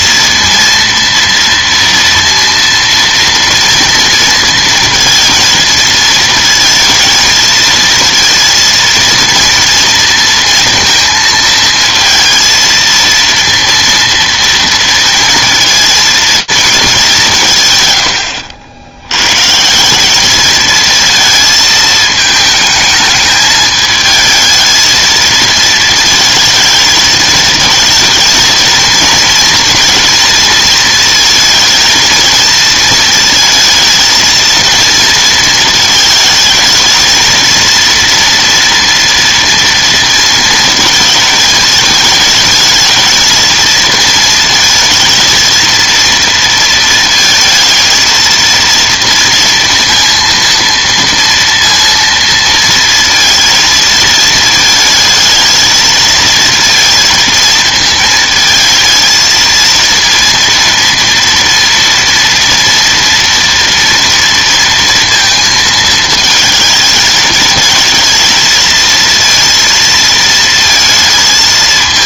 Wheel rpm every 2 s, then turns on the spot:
230, 230, 230, 230, 230, 230, 230, 230, 220, 80, 220, 220, 220, 220, 220, 230, 220, 230, 220, 230, 230, 220, 220, 230, 230, 230, 220, 220, 230, 220, 230, 230, 230, 220, 230, 230.
none